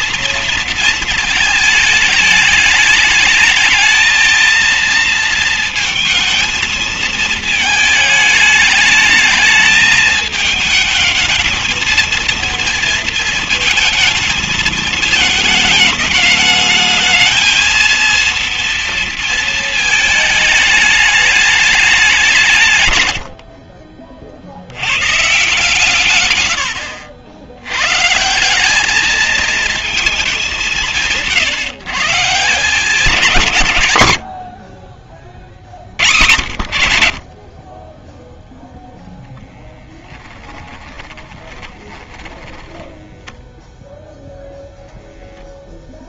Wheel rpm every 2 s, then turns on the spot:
230, 220, 230, 230, 210, 220, 230, 220, 220, 230, 220, 180, 110, 80, 180, 170, 180, 40, 80, 0, 10, 20, 0.
40-44